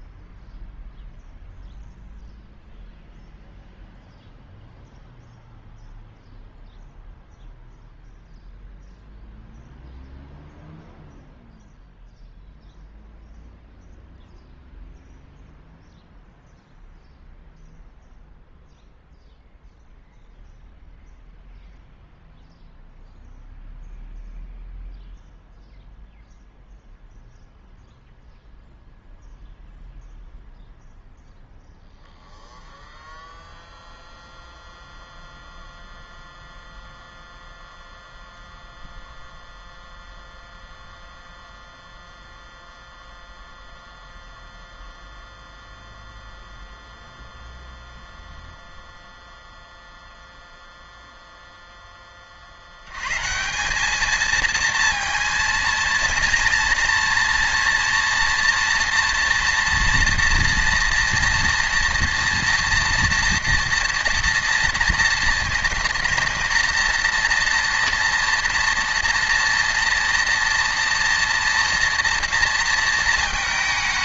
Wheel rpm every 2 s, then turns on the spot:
0, 0, 0, 0, 0, 0, 0, 0, 0, 0, 0, 0, 0, 0, 0, 0, 0, 0, 0, 0, 0, 0, 0, 0, 0, 0, 50, 230, 230, 230, 230, 230, 230, 230, 240, 230, 230.
none